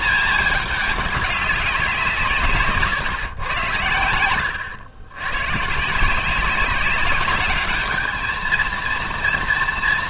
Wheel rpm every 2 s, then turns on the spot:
210, 140, 100, 190, 230.
4-6